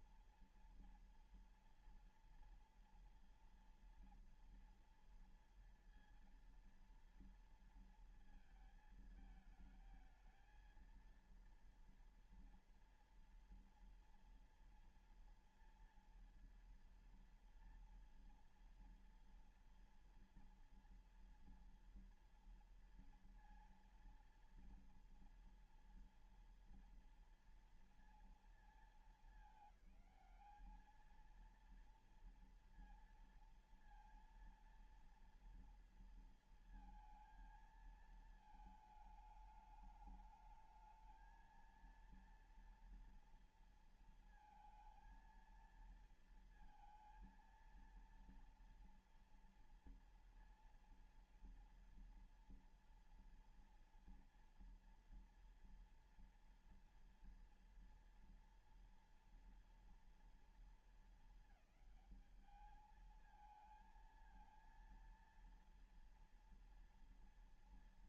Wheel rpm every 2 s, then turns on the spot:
230, 230, 230, 230, 230, 220, 230, 230, 230, 230, 230, 230, 230, 240, 230, 210, 230, 230, 230, 220, 210, 230, 230, 230, 230, 230, 230, 240, 240, 230, 230, 220, 230, 230.
none